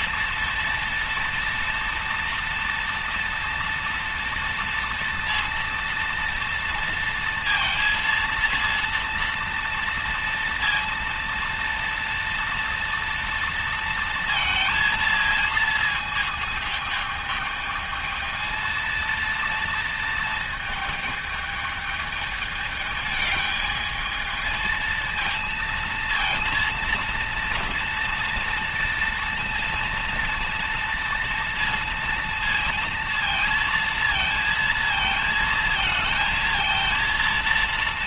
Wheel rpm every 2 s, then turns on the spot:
230, 230, 230, 230, 230, 230, 230, 220, 220, 230, 220, 210, 220, 230, 230, 230, 230, 230, 230.
none